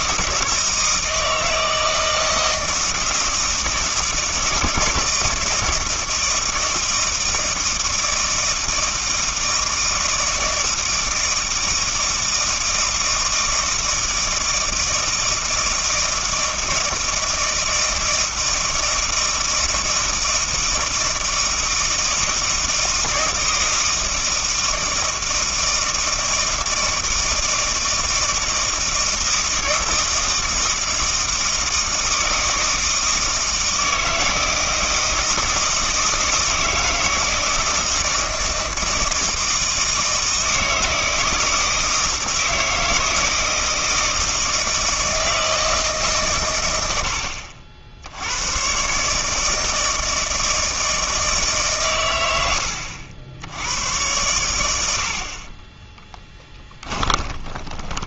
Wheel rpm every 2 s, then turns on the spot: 160, 160, 160, 160, 160, 160, 160, 160, 160, 160, 160, 160, 160, 160, 160, 160, 160, 160, 160, 160, 160, 160, 160, 110, 120, 160, 90, 90, 10.
56-58